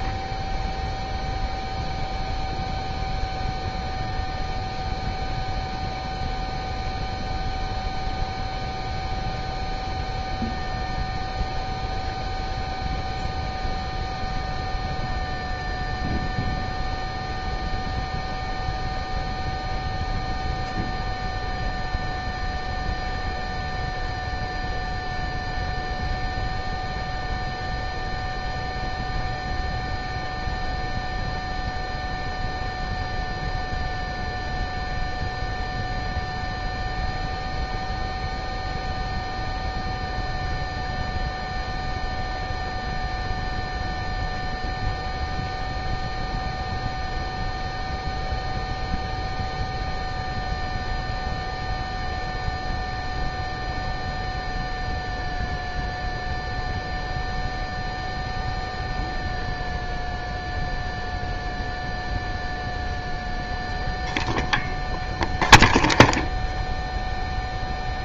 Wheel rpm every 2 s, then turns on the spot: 0, 0, 0, 0, 0, 0, 0, 0, 0, 0, 0, 0, 0, 0, 0, 0, 0, 0, 0, 0, 0, 0, 0, 0, 0, 0, 0, 0, 0, 0, 0, 0, 0, 0.
none